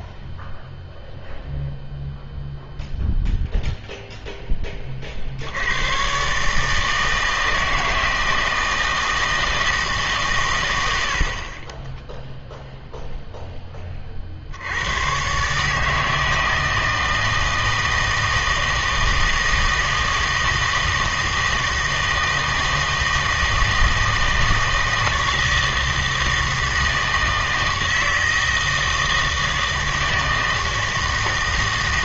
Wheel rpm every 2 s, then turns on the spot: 0, 0, 20, 160, 160, 90, 0, 90, 160, 160, 160, 160, 160, 160, 160, 160.
none